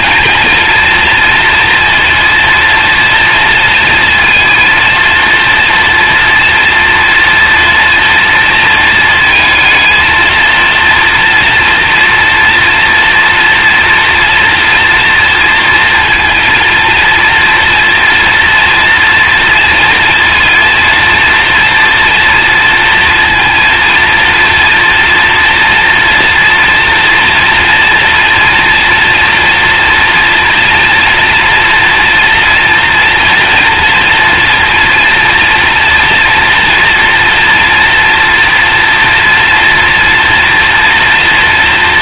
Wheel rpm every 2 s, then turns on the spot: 230, 230, 230, 230, 220, 230, 230, 240, 230, 230, 230, 240, 230, 230, 230, 230, 230, 230, 240, 240, 230.
none